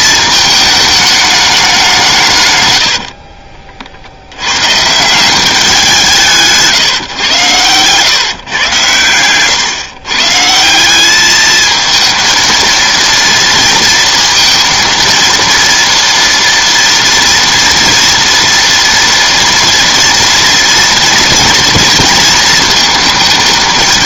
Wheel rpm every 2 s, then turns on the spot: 220, 140, 100, 160, 120, 150, 230, 230, 230, 230, 230, 220.
none